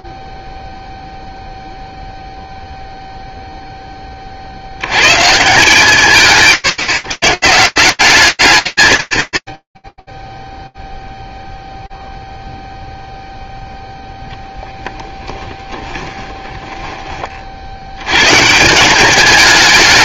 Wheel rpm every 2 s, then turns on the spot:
0, 0, 120, 140, 160, 0, 0, 10, 10, 150.
16-18